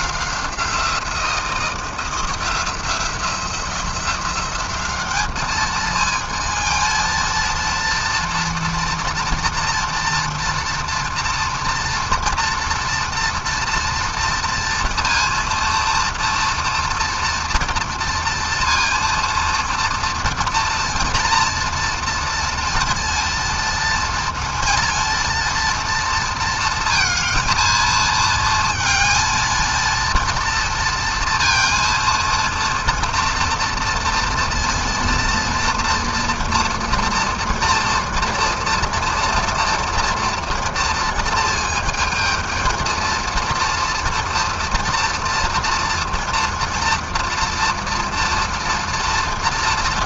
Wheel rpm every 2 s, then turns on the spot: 180, 170, 180, 220, 230, 230, 240, 230, 240, 230, 240, 230, 230, 230, 230, 230, 230, 230, 240, 230, 230, 220, 230, 230, 230.
none